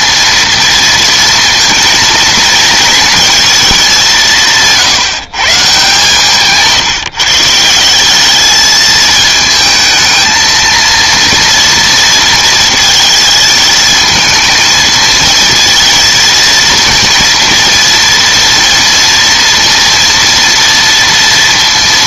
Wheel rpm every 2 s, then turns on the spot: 230, 220, 160, 150, 220, 230, 230, 230, 230, 230, 230.
none